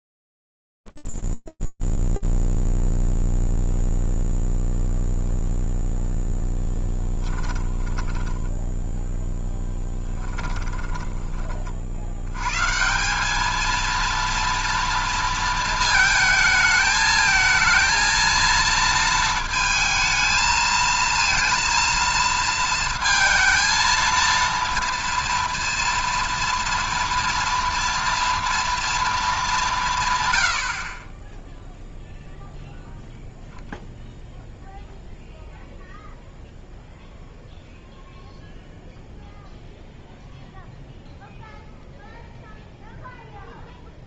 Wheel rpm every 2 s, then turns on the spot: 0, 0, 0, 10, 0, 10, 180, 230, 220, 220, 230, 230, 230, 230, 220, 30, 0, 0, 0, 0, 0, 0.
6-8 10-12